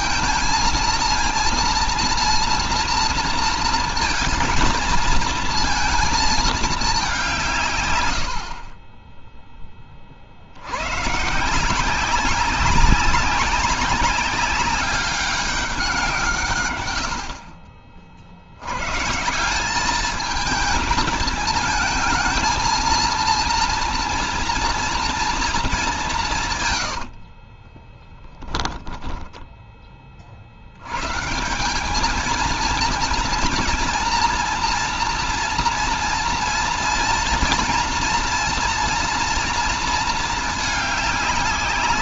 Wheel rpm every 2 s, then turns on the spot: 230, 230, 220, 210, 40, 90, 190, 190, 130, 110, 220, 220, 230, 120, 10, 80, 230, 230, 230, 240, 210.
26-28